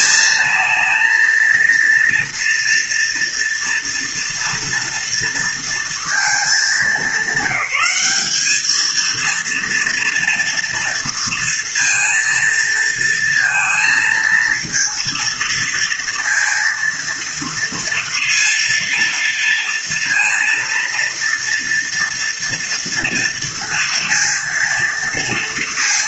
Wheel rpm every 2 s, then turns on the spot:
220, 240, 230, 210, 210, 230, 230, 230, 230, 230, 230, 230, 230.
none